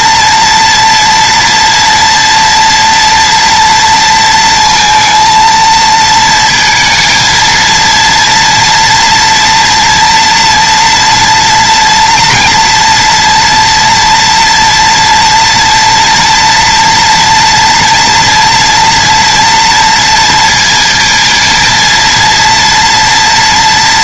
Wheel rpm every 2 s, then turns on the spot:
240, 230, 230, 230, 230, 240, 230, 230, 230, 230, 230, 230.
none